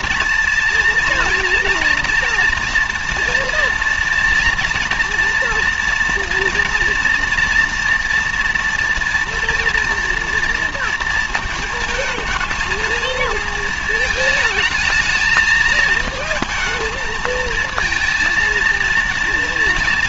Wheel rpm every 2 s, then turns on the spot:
230, 230, 230, 230, 230, 230, 220, 220, 230, 230.
none